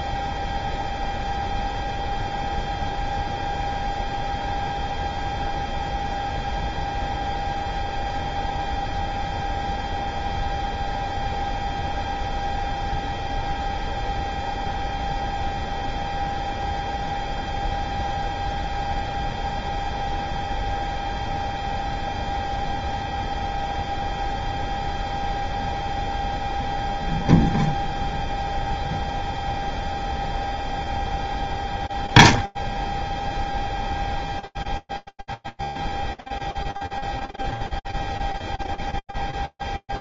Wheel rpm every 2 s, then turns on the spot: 0, 0, 0, 0, 0, 0, 0, 0, 0, 0, 0, 0, 0, 0, 0, 0, 0, 0, 0, 0.
none